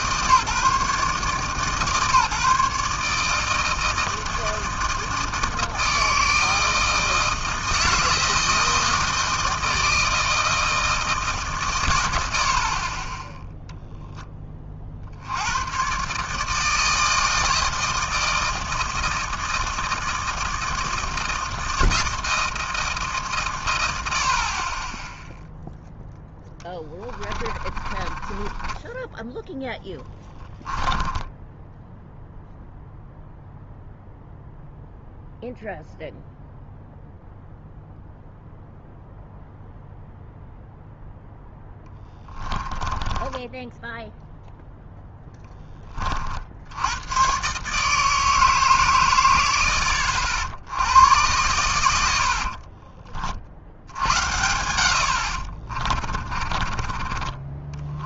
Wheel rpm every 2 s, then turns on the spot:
140, 150, 160, 160, 160, 150, 10, 70, 160, 160, 160, 140, 0, 20, 10, 10, 0, 0, 0, 0, 0, 10, 10, 120, 110, 100, 40, 60, 20.
26-28 30-32 42-44 54-56